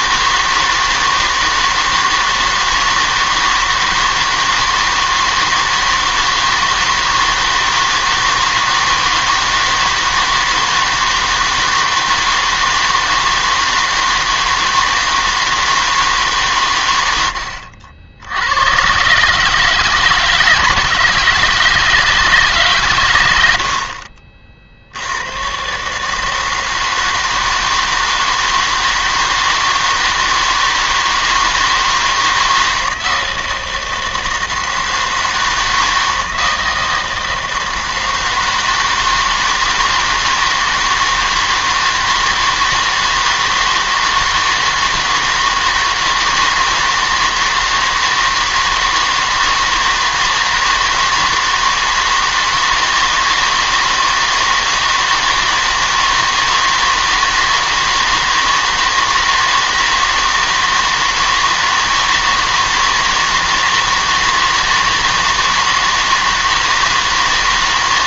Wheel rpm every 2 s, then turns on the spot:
160, 160, 160, 160, 160, 160, 160, 160, 120, 110, 160, 140, 50, 160, 160, 160, 160, 160, 160, 160, 160, 160, 160, 160, 160, 160, 160, 160, 160, 160, 160, 160, 160, 160.
none